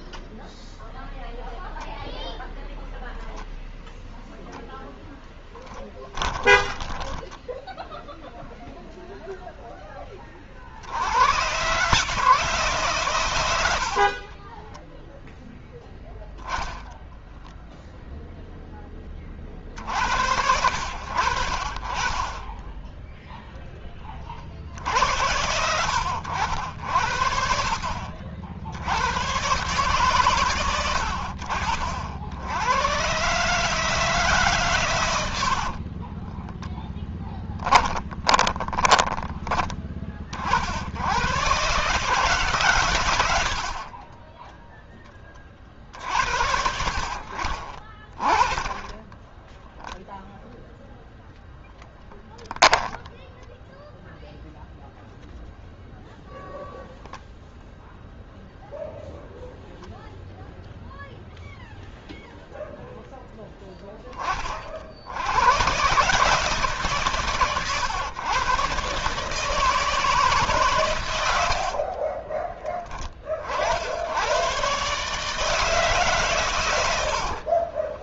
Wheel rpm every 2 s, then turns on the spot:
0, 0, 20, 0, 30, 150, 30, 0, 0, 60, 40, 20, 90, 70, 130, 70, 150, 50, 10, 20, 120, 70, 30, 50, 10, 0, 0, 0, 0, 0, 0, 0, 80, 130, 140, 100, 40, 140, 70.
4-6 12-14 34-38 46-50 76-78